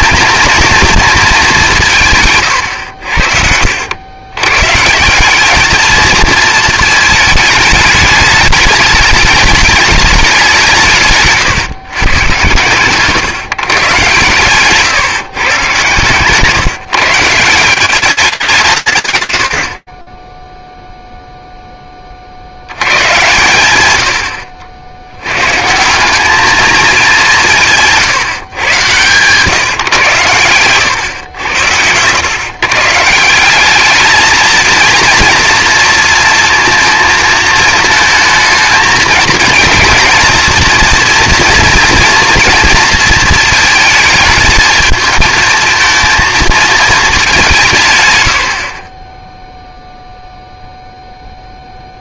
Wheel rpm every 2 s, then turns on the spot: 220, 120, 130, 220, 210, 170, 120, 130, 160, 160, 0, 80, 80, 220, 130, 110, 140, 230, 230, 220, 230, 230, 220, 230, 40, 0.
2-4 48-50